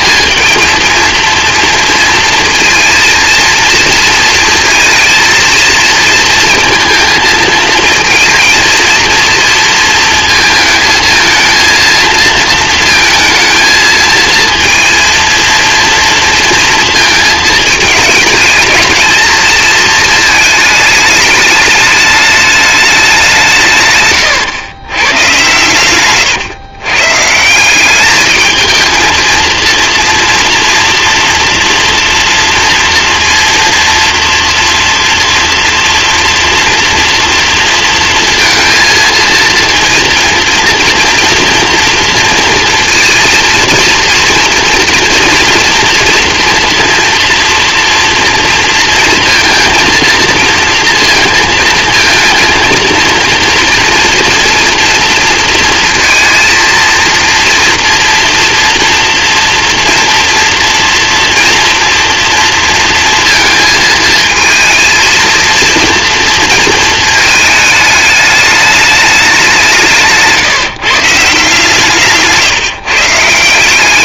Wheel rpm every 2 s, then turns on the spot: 220, 230, 230, 230, 230, 230, 220, 230, 230, 220, 220, 210, 120, 130, 220, 230, 230, 230, 240, 230, 230, 230, 230, 240, 230, 230, 230, 230, 230, 230, 230, 230, 220, 230, 210, 150, 150.
none